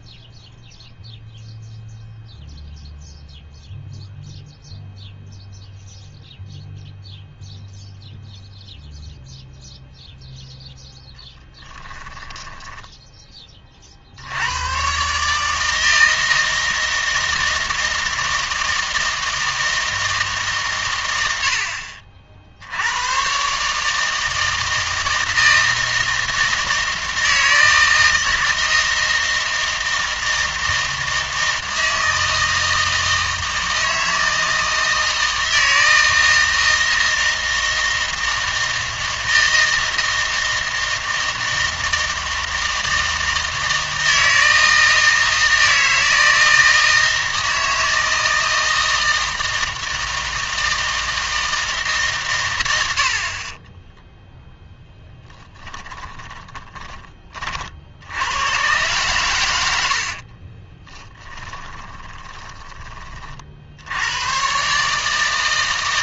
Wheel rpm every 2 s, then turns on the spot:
0, 0, 0, 0, 0, 0, 10, 120, 160, 160, 130, 80, 160, 160, 160, 160, 160, 160, 160, 160, 160, 160, 160, 160, 160, 160, 100, 0, 10, 120, 20, 30, 150.
12-14 56-58 60-62